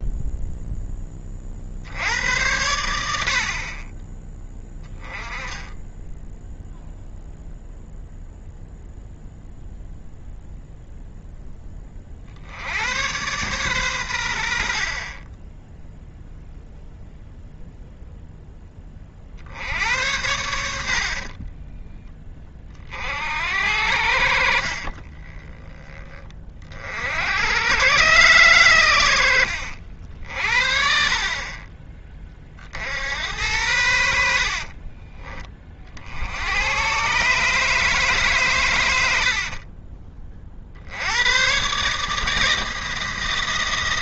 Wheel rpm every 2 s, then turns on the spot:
0, 80, 10, 0, 0, 0, 80, 60, 0, 10, 80, 50, 60, 50, 110, 50, 50, 50, 100, 120, 50, 160.
24-26 34-36